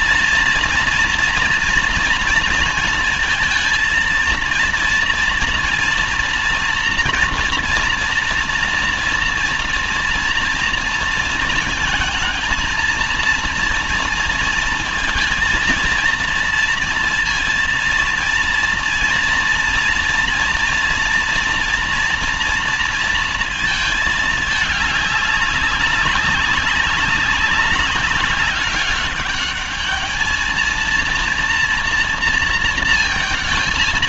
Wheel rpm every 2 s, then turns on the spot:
230, 230, 230, 230, 230, 230, 230, 230, 230, 230, 230, 230, 210, 200, 200, 230, 230.
none